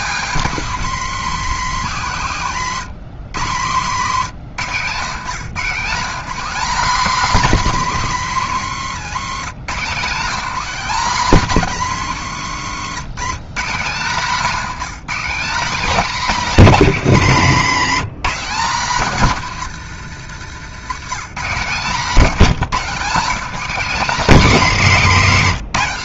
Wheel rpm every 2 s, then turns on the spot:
210, 140, 140, 230, 150, 200, 160, 200, 210, 190, 140, 190, 200.
none